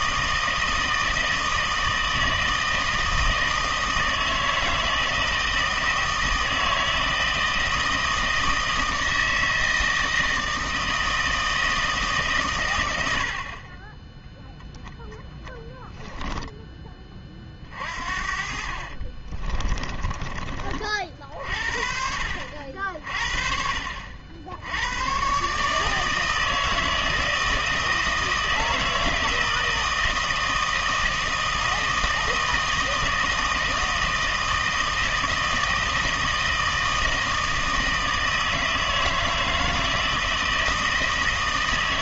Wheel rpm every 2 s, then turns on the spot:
160, 160, 160, 160, 160, 160, 110, 10, 10, 50, 30, 60, 80, 160, 160, 160, 160, 160, 160, 160, 160.
18-20